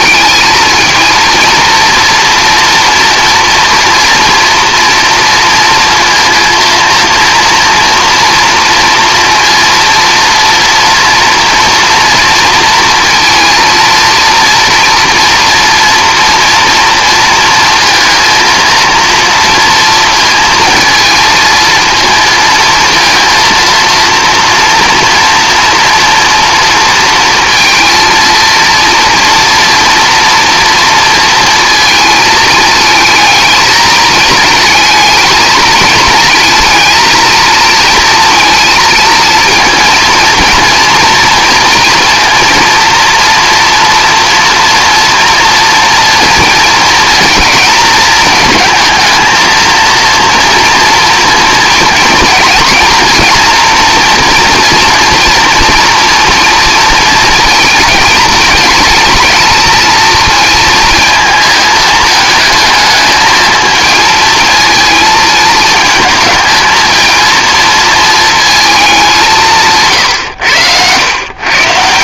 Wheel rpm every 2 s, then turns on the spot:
220, 230, 230, 230, 230, 240, 230, 230, 230, 230, 220, 230, 230, 230, 230, 230, 220, 220, 230, 230, 230, 230, 230, 230, 220, 230, 230, 240, 240, 220, 230, 220, 220, 220, 220, 90.
none